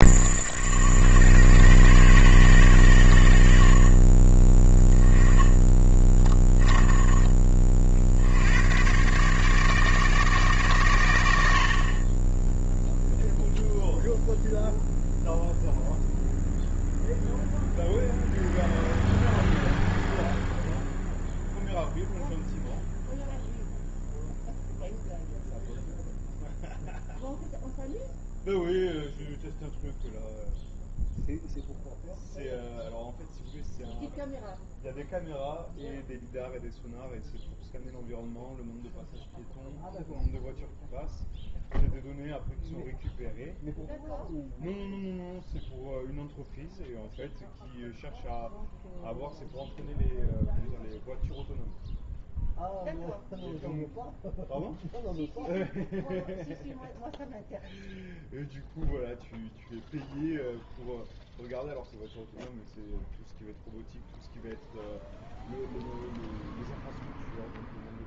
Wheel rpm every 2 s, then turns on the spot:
100, 90, 10, 10, 120, 110, 0, 0, 0, 0, 0, 0, 0, 0, 0, 0, 0, 0, 0, 0, 0, 0, 0, 0, 0, 0, 0, 0, 0, 0, 0, 0, 0, 0.
none